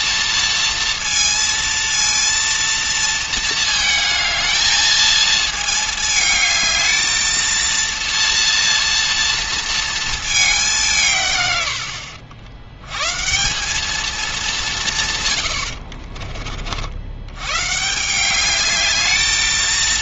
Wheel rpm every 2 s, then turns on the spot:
230, 230, 220, 220, 230, 190, 100, 170, 50, 210.
none